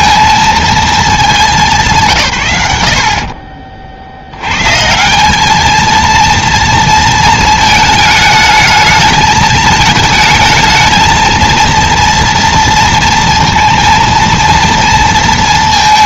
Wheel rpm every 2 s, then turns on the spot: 220, 80, 140, 230, 220, 220, 230, 230.
none